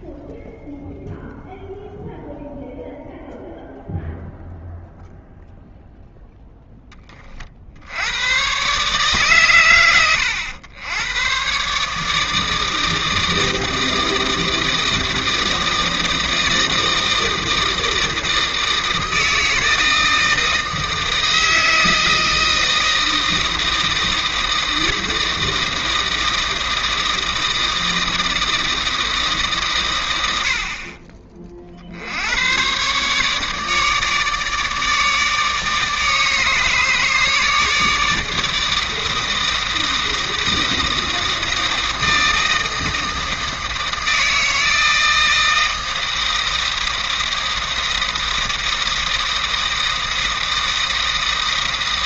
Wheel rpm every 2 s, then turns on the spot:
0, 0, 0, 10, 140, 100, 160, 160, 160, 160, 160, 160, 160, 160, 160, 50, 130, 150, 150, 160, 160, 160, 160, 160, 160, 160.
none